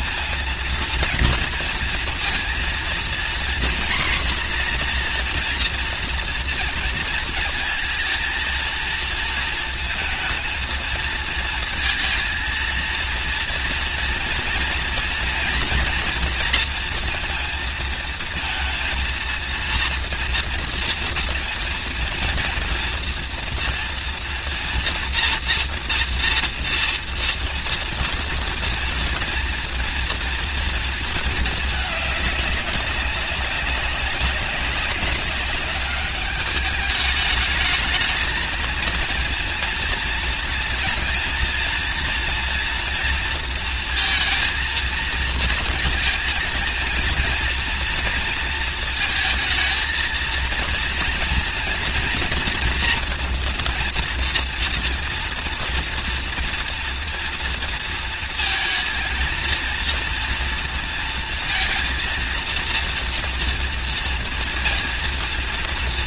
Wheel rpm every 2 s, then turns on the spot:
230, 230, 250, 230, 230, 230, 230, 230, 230, 230, 230, 230, 230, 230, 230, 230, 200, 200, 210, 230, 230, 240, 230, 230, 230, 230, 240, 240, 230, 230, 230, 230, 230.
none